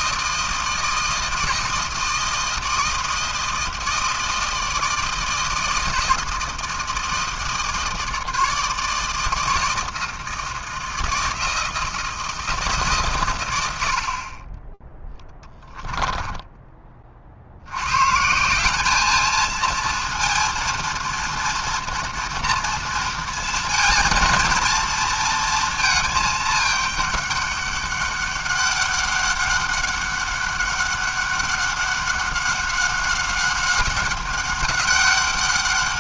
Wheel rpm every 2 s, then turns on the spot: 160, 160, 160, 160, 160, 160, 160, 20, 10, 180, 230, 230, 230, 210, 200, 200, 190, 200.
none